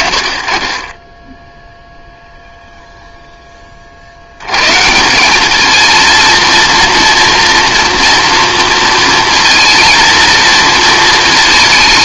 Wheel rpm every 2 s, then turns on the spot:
40, 0, 140, 230, 230, 230.
none